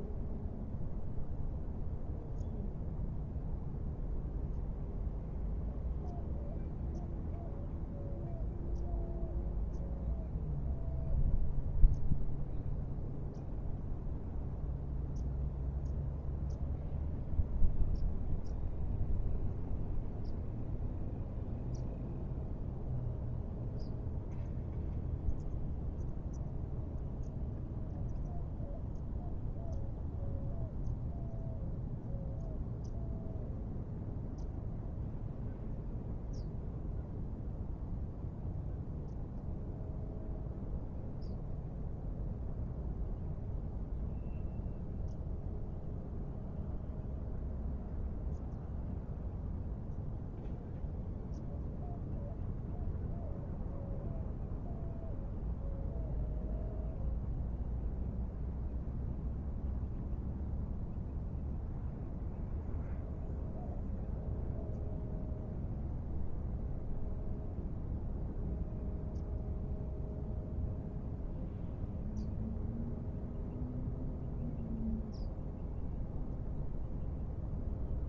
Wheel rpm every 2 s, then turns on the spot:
0, 0, 0, 0, 0, 0, 0, 0, 0, 0, 0, 0, 0, 0, 0, 0, 0, 0, 0, 0, 0, 0, 0, 0, 0, 0, 0, 0, 0, 0, 0, 0, 0, 0, 0, 0, 0, 0, 0.
none